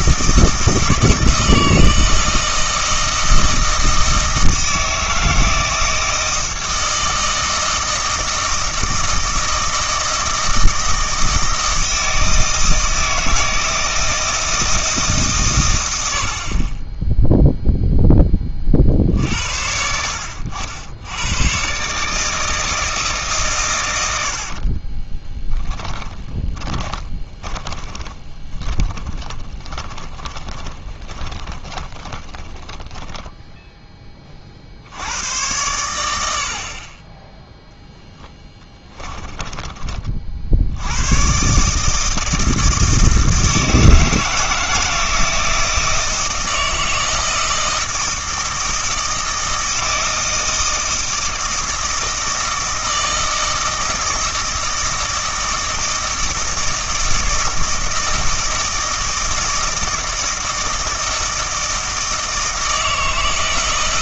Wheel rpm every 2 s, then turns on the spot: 160, 160, 160, 160, 160, 160, 160, 160, 30, 40, 70, 160, 40, 20, 20, 20, 10, 60, 30, 20, 70, 160, 160, 160, 160, 160, 160, 160, 160, 160, 160, 160.
24-34 38-40